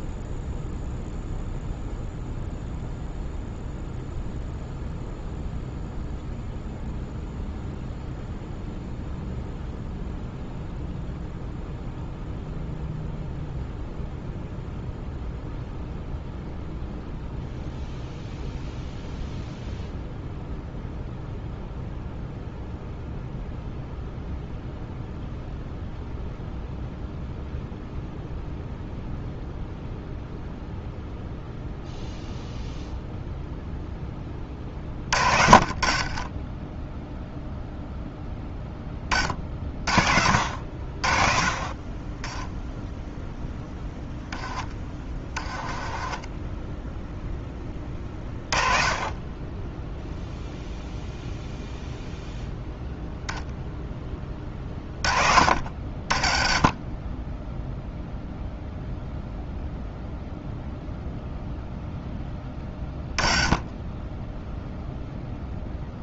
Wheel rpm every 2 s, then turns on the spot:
0, 0, 0, 0, 0, 0, 0, 0, 0, 0, 0, 0, 0, 0, 0, 0, 0, 50, 0, 20, 50, 0, 20, 10, 30, 0, 0, 50, 20, 0, 0, 20, 0.
34-36 44-46